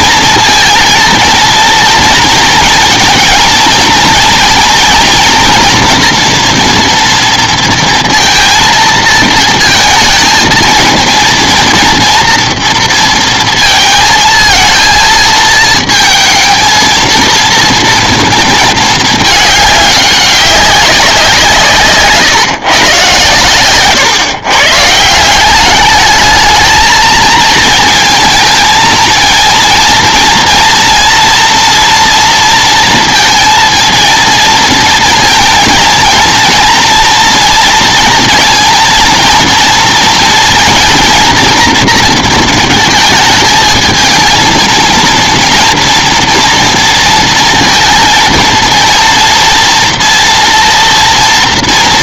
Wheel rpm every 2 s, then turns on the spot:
230, 230, 230, 230, 230, 230, 230, 230, 230, 220, 190, 160, 140, 220, 220, 230, 230, 230, 230, 230, 230, 230, 220, 230, 230, 230.
none